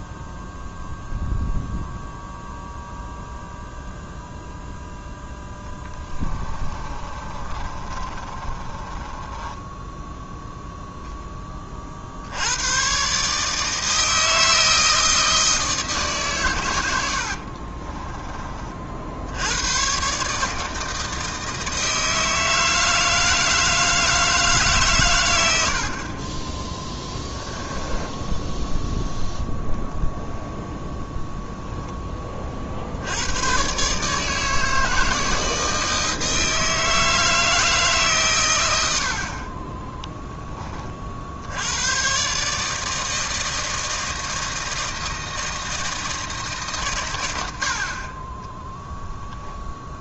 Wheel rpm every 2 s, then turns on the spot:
0, 0, 0, 20, 30, 10, 110, 160, 110, 40, 160, 160, 150, 20, 10, 0, 60, 160, 160, 110, 40, 150, 160, 130, 10.
6-10 48-50